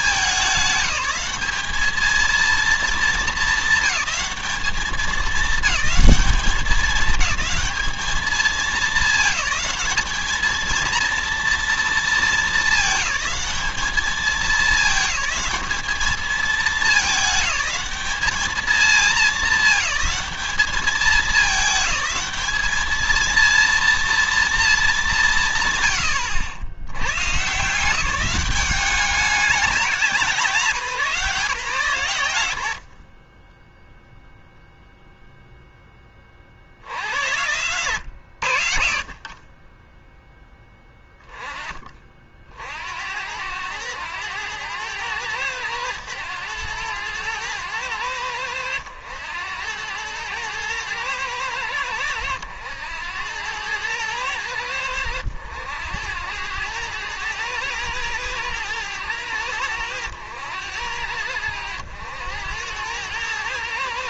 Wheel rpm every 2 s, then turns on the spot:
190, 230, 210, 200, 220, 230, 220, 200, 210, 210, 210, 220, 210, 90, 200, 170, 70, 0, 60, 60, 10, 60, 100, 100, 90, 110, 90, 90, 100, 110, 90, 100.
none